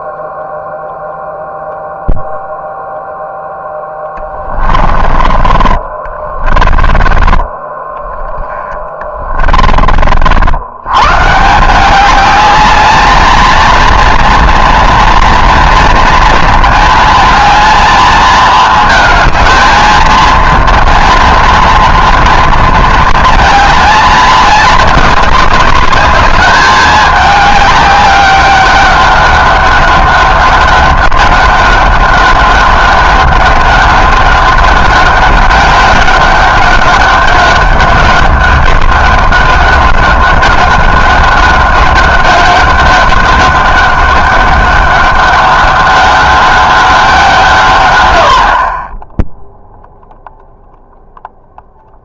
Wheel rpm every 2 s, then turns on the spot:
0, 0, 30, 20, 20, 90, 210, 230, 230, 220, 230, 230, 210, 210, 200, 200, 200, 200, 200, 200, 200, 200, 190, 200, 40, 0.
4-10